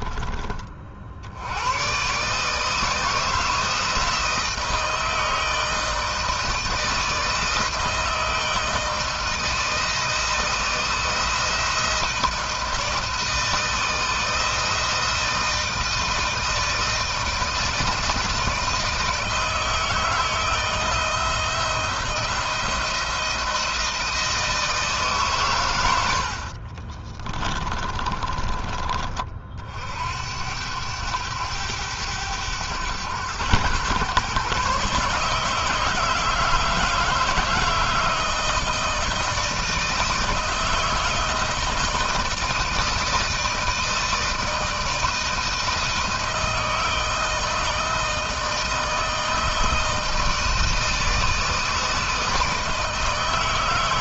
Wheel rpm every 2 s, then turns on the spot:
40, 150, 160, 160, 160, 160, 160, 160, 160, 160, 160, 160, 150, 50, 30, 90, 100, 140, 160, 160, 160, 160, 160, 160, 160, 160, 160.
26-28